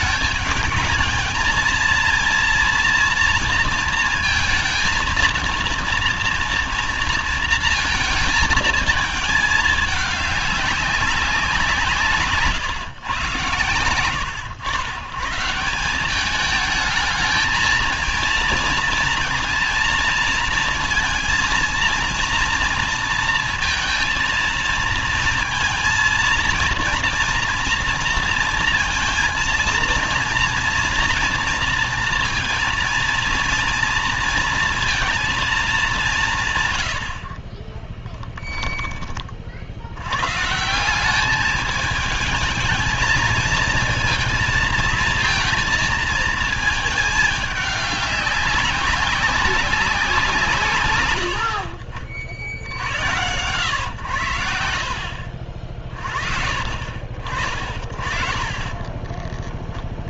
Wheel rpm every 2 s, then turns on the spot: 210, 230, 230, 230, 220, 200, 140, 90, 210, 230, 230, 230, 230, 230, 230, 230, 230, 230, 130, 10, 130, 220, 230, 220, 190, 140, 60, 80, 50, 40.
58-60